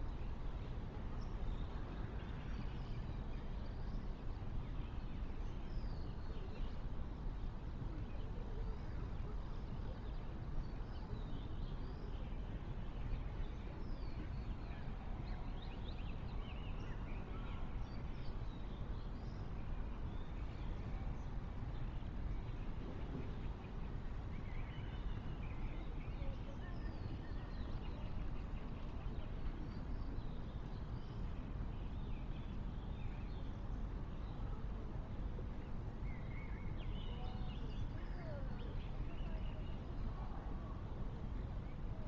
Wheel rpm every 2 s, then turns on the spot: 0, 0, 0, 0, 0, 0, 0, 0, 0, 0, 0, 0, 0, 0, 0, 0, 0, 0, 0, 0, 0.
none